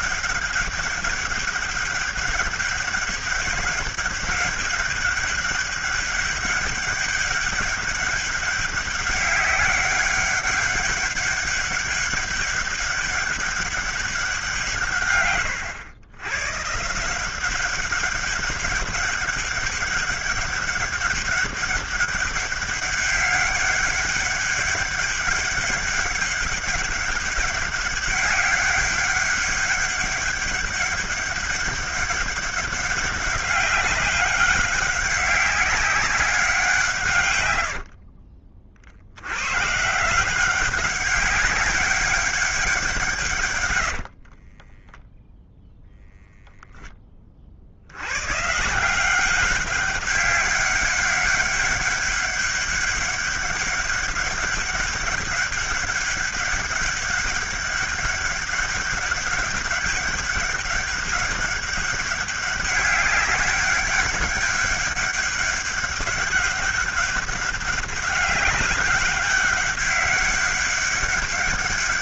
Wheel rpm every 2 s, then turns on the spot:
200, 200, 200, 200, 190, 200, 200, 160, 140, 190, 200, 200, 200, 200, 200, 200, 200, 190, 180, 60, 190, 190, 30, 0, 150, 200, 200, 200, 200, 200, 200, 200, 200, 200, 200, 200.
44-46